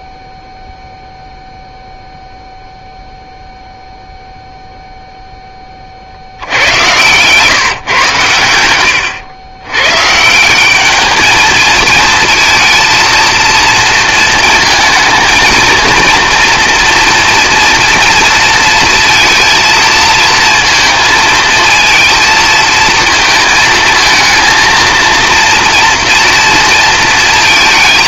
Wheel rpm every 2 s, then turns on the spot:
0, 0, 0, 90, 100, 190, 230, 220, 230, 230, 230, 230, 230, 230.
none